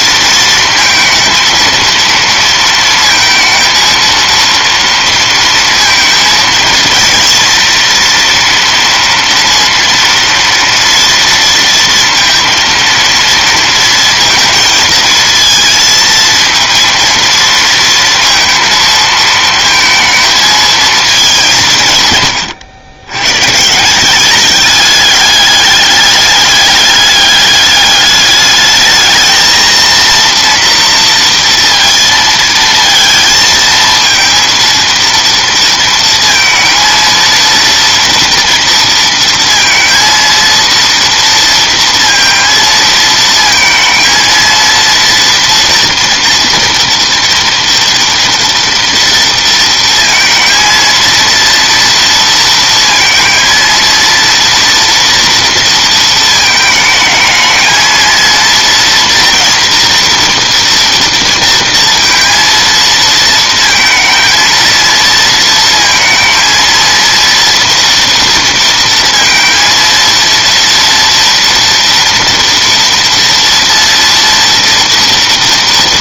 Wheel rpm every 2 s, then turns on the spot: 230, 230, 230, 240, 230, 230, 230, 230, 230, 220, 180, 120, 200, 210, 220, 230, 220, 230, 230, 230, 230, 230, 230, 230, 230, 230, 230, 230, 220, 230, 230, 230, 230, 230, 230, 240, 230, 230.
none